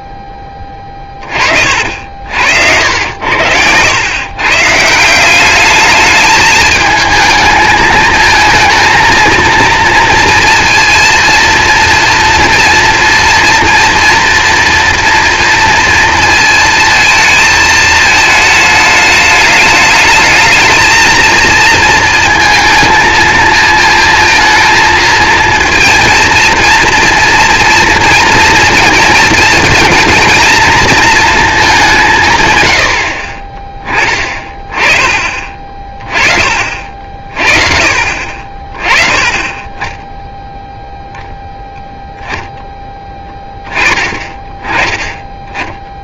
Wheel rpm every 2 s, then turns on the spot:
10, 80, 140, 210, 220, 230, 230, 230, 230, 220, 220, 220, 230, 230, 230, 230, 120, 30, 40, 30, 0, 10, 10.
none